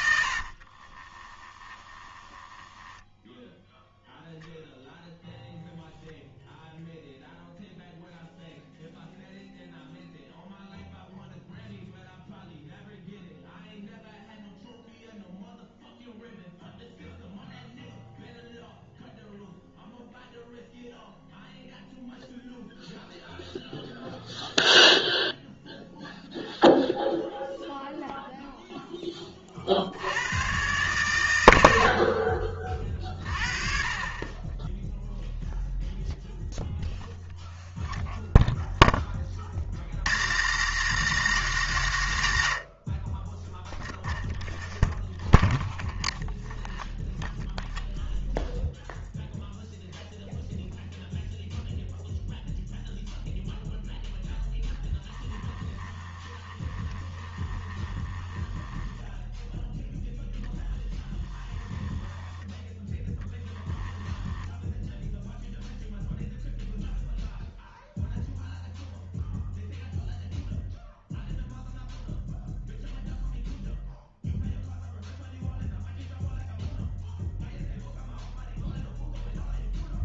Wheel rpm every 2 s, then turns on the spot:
40, 10, 0, 0, 0, 0, 0, 0, 0, 0, 0, 0, 0, 0, 0, 120, 40, 10, 0, 0, 200, 80, 0, 0, 0, 0, 0, 0, 20, 10, 20, 10, 0, 0, 0, 0, 0, 0, 0, 0.
0-4 56-62